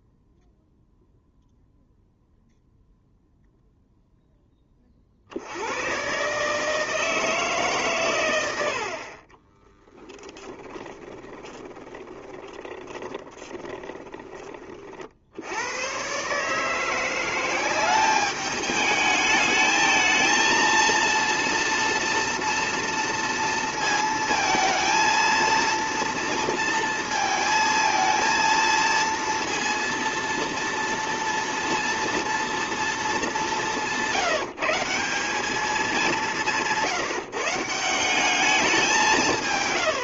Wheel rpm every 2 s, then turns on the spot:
0, 0, 20, 150, 80, 10, 10, 30, 150, 210, 230, 230, 230, 230, 230, 230, 230, 170, 170, 190.
8-14